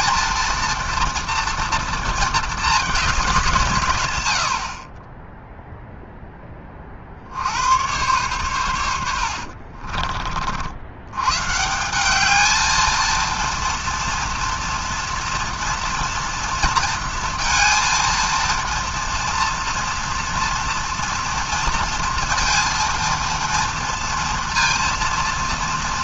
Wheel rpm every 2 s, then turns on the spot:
230, 220, 50, 30, 100, 80, 220, 230, 230, 230, 240, 230, 230.
none